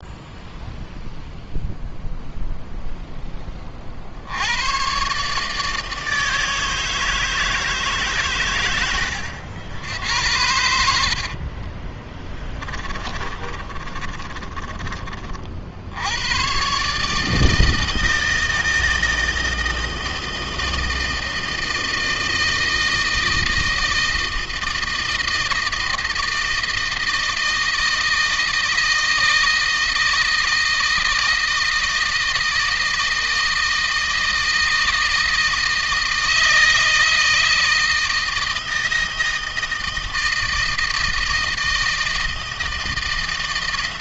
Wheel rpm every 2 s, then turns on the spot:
0, 10, 130, 160, 100, 60, 20, 30, 140, 160, 160, 160, 160, 160, 160, 160, 160, 160, 160, 160, 160, 160.
10-14